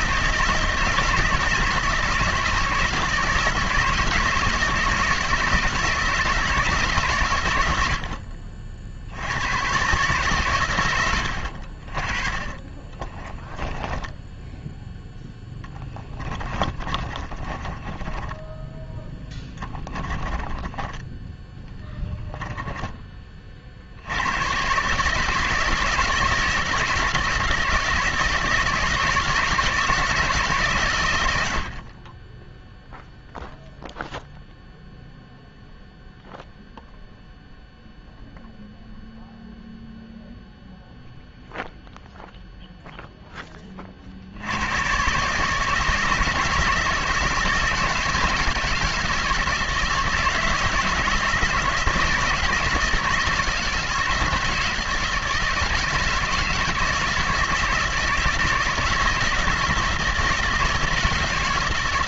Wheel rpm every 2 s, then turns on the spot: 160, 160, 160, 160, 50, 120, 20, 0, 30, 10, 10, 10, 110, 160, 160, 150, 10, 0, 0, 0, 0, 0, 100, 160, 160, 160, 160, 160, 160, 160, 160.
12-14 16-22